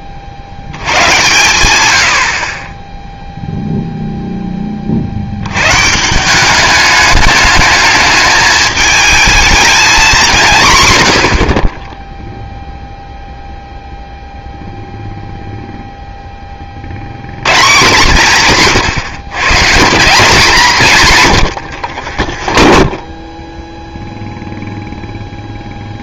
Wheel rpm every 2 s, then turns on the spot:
70, 10, 20, 200, 220, 140, 0, 0, 40, 150, 180, 20, 0.
22-24